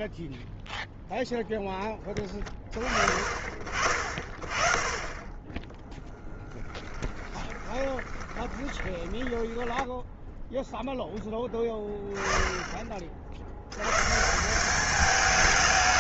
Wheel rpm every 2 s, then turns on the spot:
0, 30, 30, 10, 10, 0, 20, 190.
6-10